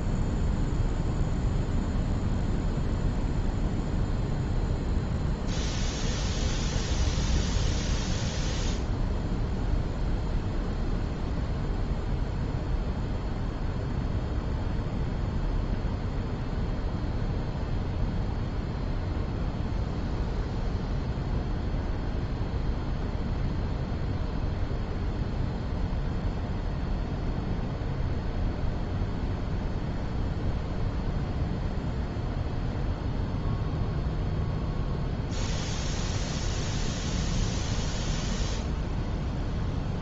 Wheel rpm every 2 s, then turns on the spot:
0, 0, 0, 0, 0, 0, 0, 0, 0, 0, 0, 0, 0, 0, 0, 0, 0, 0, 0, 0.
none